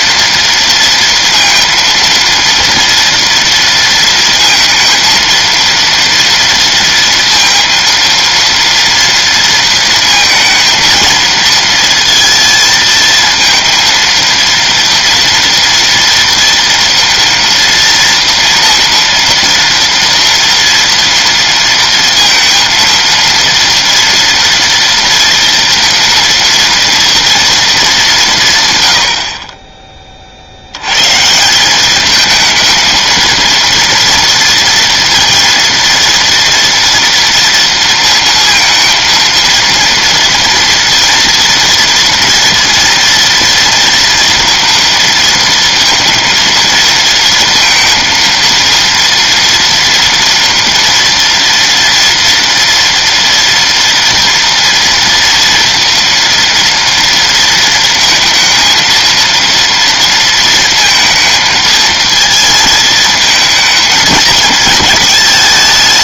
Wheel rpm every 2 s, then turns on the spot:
230, 230, 230, 230, 230, 230, 230, 230, 230, 230, 230, 230, 230, 230, 150, 70, 220, 230, 240, 230, 230, 230, 230, 230, 230, 230, 230, 230, 230, 230, 230, 220, 220.
none